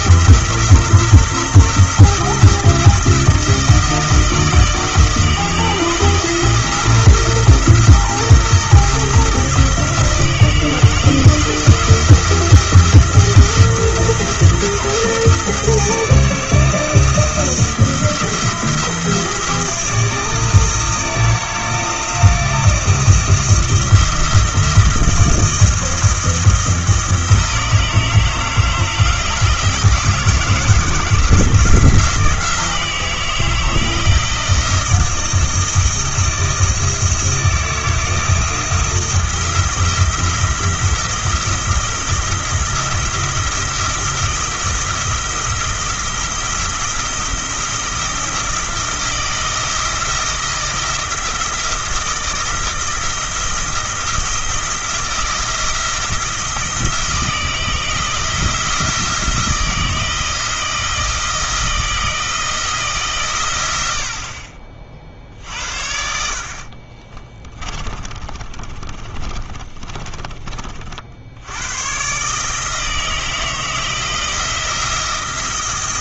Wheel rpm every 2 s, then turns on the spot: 170, 170, 160, 170, 170, 160, 170, 170, 170, 170, 160, 160, 170, 160, 160, 170, 170, 160, 170, 170, 170, 170, 170, 170, 170, 170, 170, 170, 170, 170, 160, 160, 40, 50, 40, 30, 150, 170.
66-70